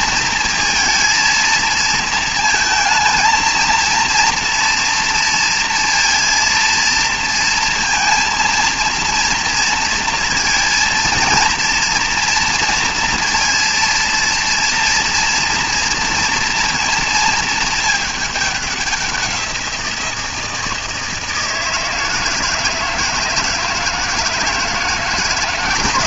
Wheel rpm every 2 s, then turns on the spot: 230, 220, 230, 230, 230, 230, 230, 230, 230, 200, 160, 160, 160.
none